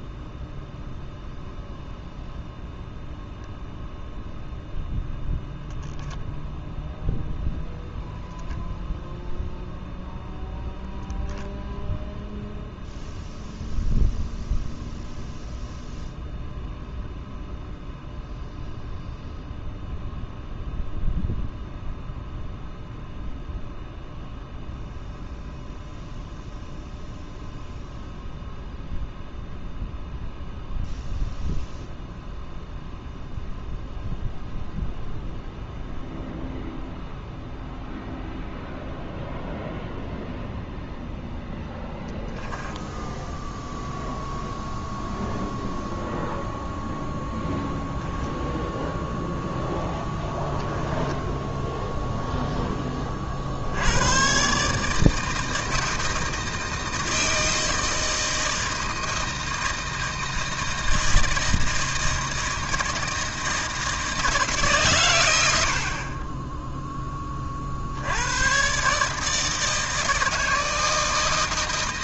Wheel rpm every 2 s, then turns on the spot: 0, 0, 0, 0, 0, 0, 0, 0, 0, 0, 0, 0, 0, 0, 0, 0, 0, 0, 0, 0, 0, 0, 0, 0, 0, 10, 20, 150, 160, 160, 160, 160, 120, 10, 140, 160.
none